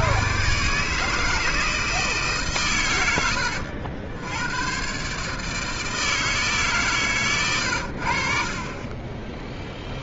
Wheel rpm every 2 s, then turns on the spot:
130, 120, 120, 150, 30.
none